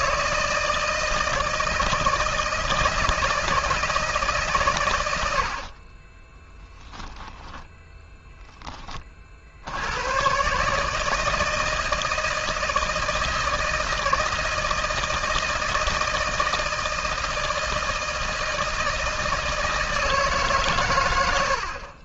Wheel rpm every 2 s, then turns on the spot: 160, 160, 130, 10, 10, 140, 160, 160, 160, 160, 140.
6-8